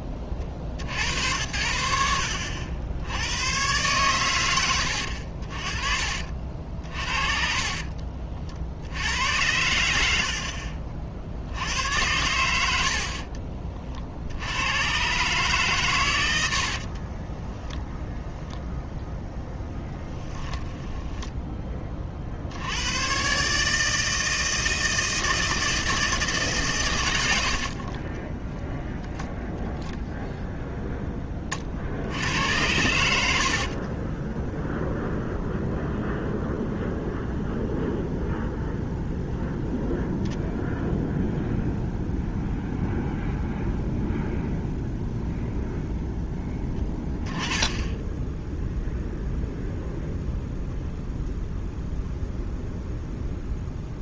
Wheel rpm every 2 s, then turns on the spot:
30, 70, 110, 50, 50, 50, 80, 100, 60, 0, 10, 80, 160, 140, 0, 0, 80, 0, 0, 0, 0, 0, 0, 10, 0, 0, 0.
6-8 10-12 16-18 20-22 46-48